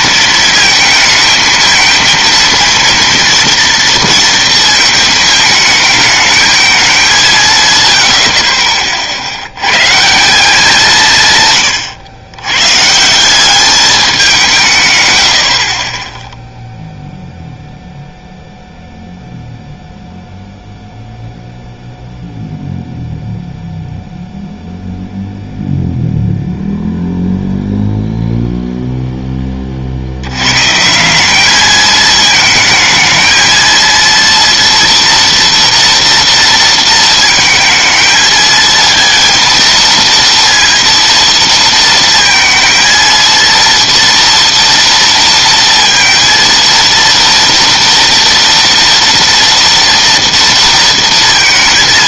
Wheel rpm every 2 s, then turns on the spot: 220, 230, 230, 210, 40, 180, 120, 160, 0, 0, 0, 0, 0, 0, 0, 130, 220, 230, 230, 220, 230, 230, 230, 230, 230, 230.
none